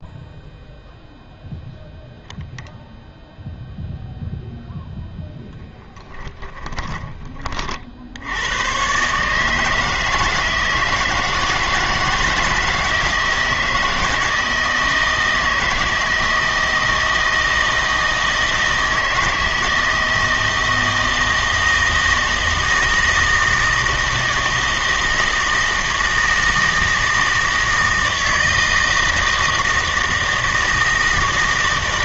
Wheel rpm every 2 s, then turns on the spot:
0, 0, 0, 10, 110, 160, 160, 160, 160, 160, 160, 160, 160, 160, 160, 160.
6-8